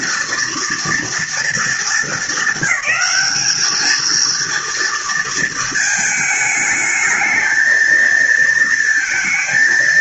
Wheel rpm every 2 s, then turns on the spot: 230, 200, 230, 220, 230.
none